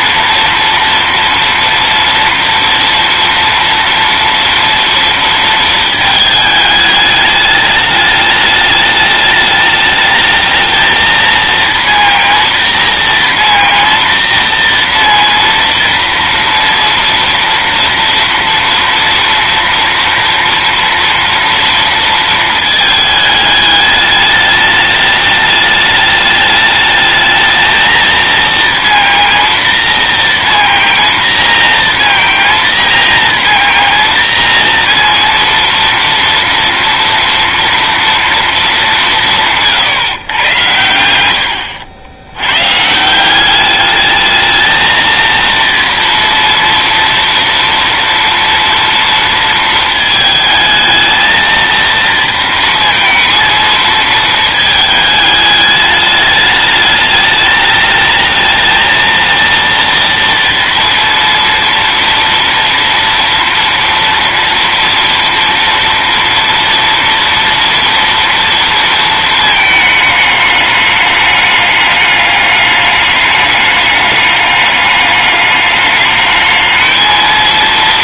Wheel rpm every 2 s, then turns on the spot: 240, 230, 230, 210, 210, 220, 230, 230, 230, 230, 230, 220, 210, 210, 230, 230, 230, 230, 230, 210, 110, 140, 220, 230, 230, 220, 230, 220, 210, 220, 230, 230, 230, 240, 230, 210, 210, 210, 220.
none